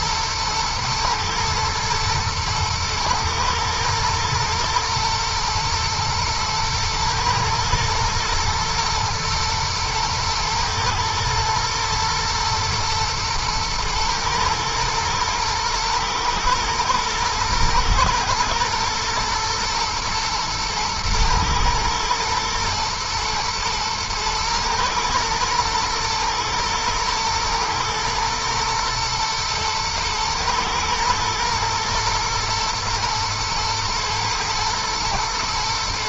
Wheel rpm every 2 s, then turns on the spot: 110, 120, 110, 110, 110, 110, 120, 110, 120, 120, 110, 120, 120, 110, 110, 120, 110, 110.
none